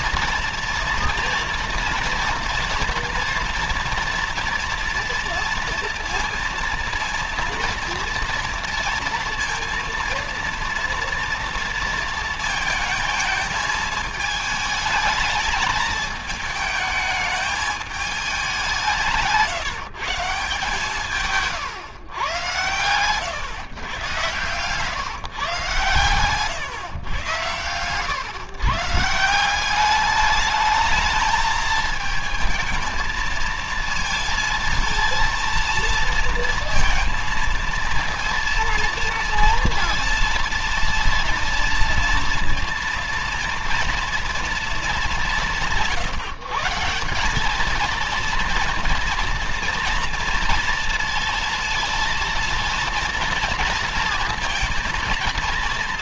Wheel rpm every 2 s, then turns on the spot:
230, 230, 230, 230, 230, 230, 220, 220, 220, 200, 160, 120, 130, 130, 140, 210, 220, 230, 230, 230, 230, 230, 210, 160, 220, 230, 230, 240.
none